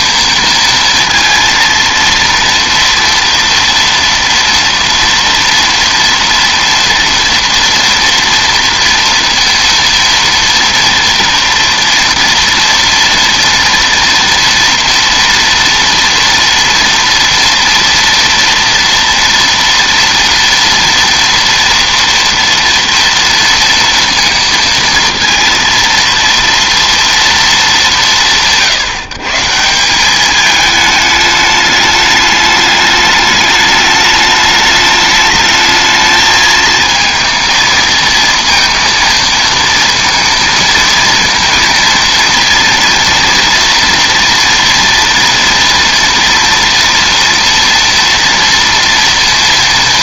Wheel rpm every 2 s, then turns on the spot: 230, 230, 230, 230, 230, 230, 230, 230, 230, 230, 230, 230, 230, 230, 160, 210, 210, 210, 220, 230, 230, 230, 230, 240, 230.
none